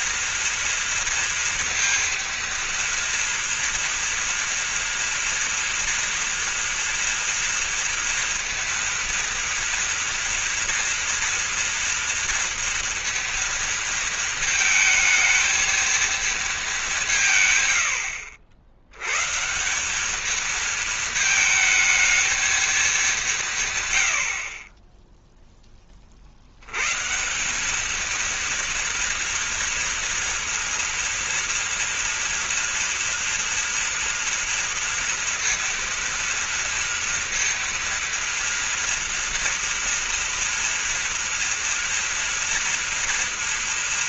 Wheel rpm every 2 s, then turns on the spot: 230, 230, 240, 230, 230, 230, 230, 220, 200, 100, 220, 210, 30, 120, 230, 230, 230, 230, 230, 230, 230, 230.
none